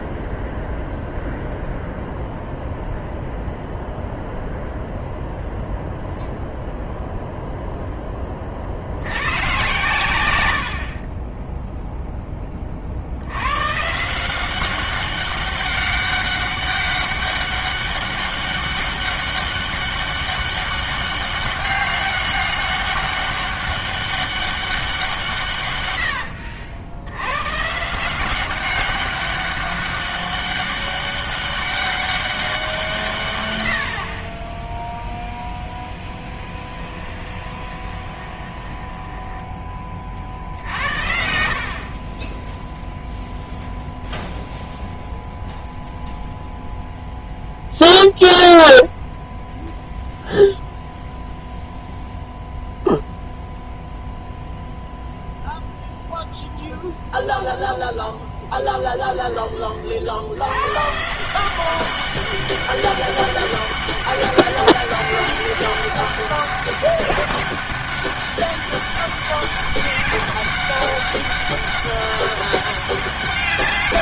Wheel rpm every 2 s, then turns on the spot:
0, 0, 0, 0, 40, 70, 20, 190, 200, 200, 200, 200, 200, 80, 190, 200, 180, 10, 20, 20, 60, 0, 0, 0, 0, 0, 0, 0, 0, 10, 110, 200, 200, 200, 200, 200, 200.
36-40